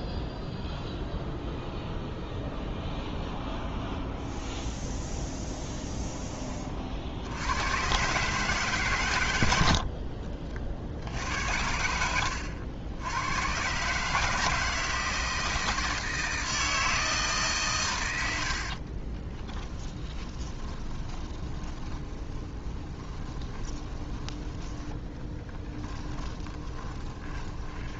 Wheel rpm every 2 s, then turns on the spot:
0, 0, 0, 30, 130, 60, 70, 160, 160, 60, 20, 10, 10, 20.
18-24 26-28